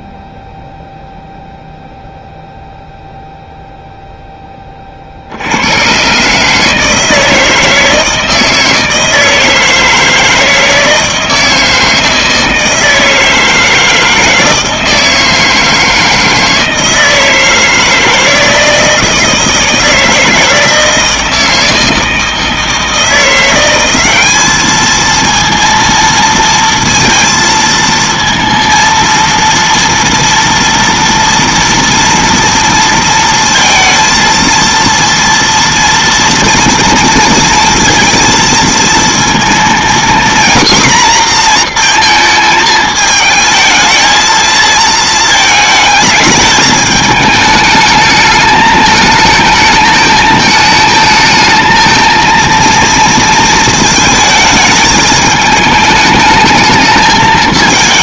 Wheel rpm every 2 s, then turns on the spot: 0, 0, 20, 160, 160, 160, 160, 160, 160, 160, 160, 160, 210, 230, 230, 230, 230, 230, 230, 230, 240, 220, 220, 220, 220, 220, 230, 220, 220.
none